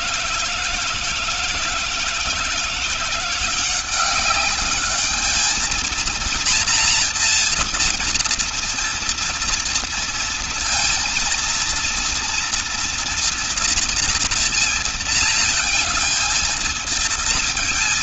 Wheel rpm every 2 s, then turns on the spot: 160, 170, 210, 230, 230, 230, 230, 230, 230.
none